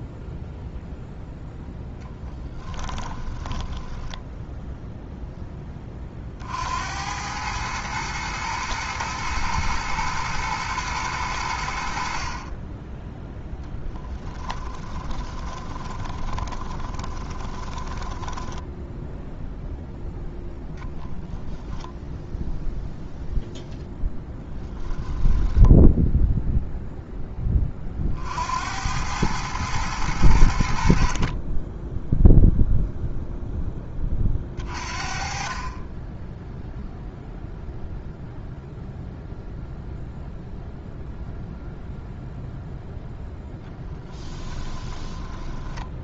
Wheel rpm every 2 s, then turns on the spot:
0, 20, 0, 90, 120, 110, 10, 20, 20, 0, 10, 0, 10, 10, 110, 20, 0, 40, 0, 0, 0, 10, 10.
14-18 20-22 24-26 42-46